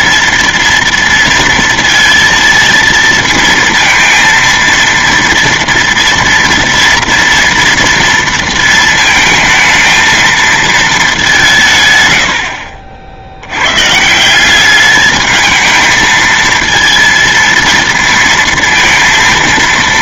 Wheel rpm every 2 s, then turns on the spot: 230, 230, 230, 230, 230, 220, 70, 190, 230, 230.
none